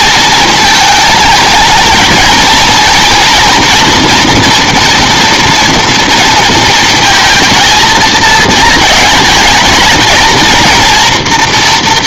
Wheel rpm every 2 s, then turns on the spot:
220, 230, 240, 230, 220, 230.
none